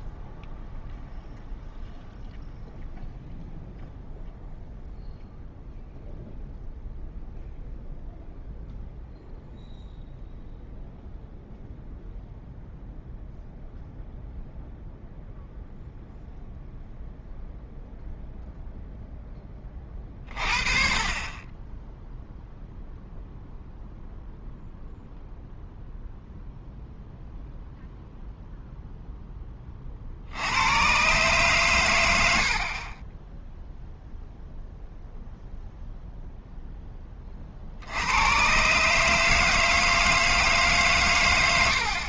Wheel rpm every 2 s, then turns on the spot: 0, 0, 0, 0, 0, 0, 0, 0, 0, 0, 40, 0, 0, 0, 0, 100, 50, 0, 0, 140, 150.
none